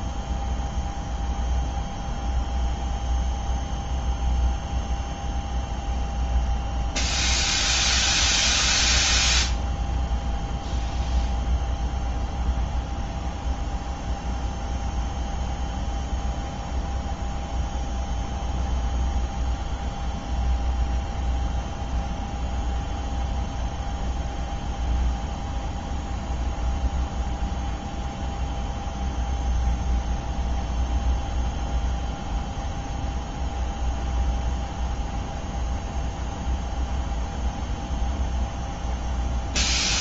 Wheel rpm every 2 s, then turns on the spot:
0, 0, 0, 0, 0, 0, 0, 0, 0, 0, 0, 0, 0, 0, 0, 0, 0, 0, 0, 0.
none